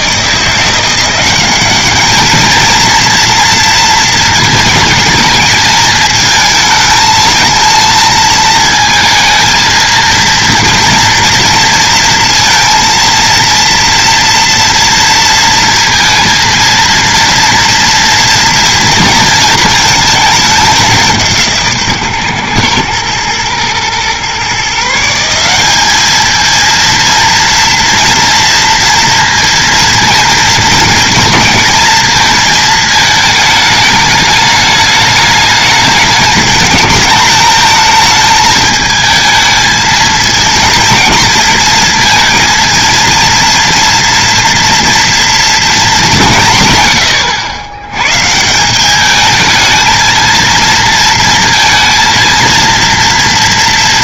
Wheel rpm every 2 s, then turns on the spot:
170, 220, 220, 220, 230, 230, 230, 230, 230, 230, 200, 110, 160, 230, 230, 220, 220, 210, 220, 220, 230, 230, 230, 140, 200, 230, 230.
none